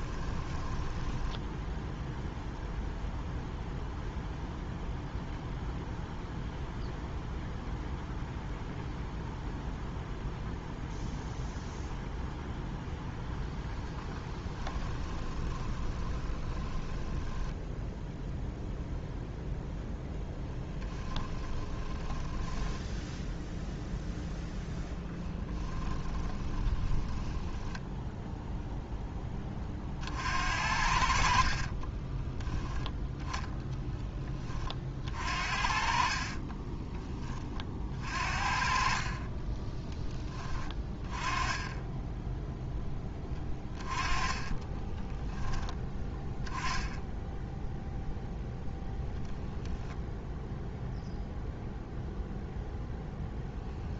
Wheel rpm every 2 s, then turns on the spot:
10, 0, 0, 0, 0, 0, 0, 20, 10, 0, 10, 0, 10, 20, 0, 60, 0, 50, 20, 40, 20, 10, 10, 10, 0, 0, 0.
0-2 14-18 20-22 26-28 44-48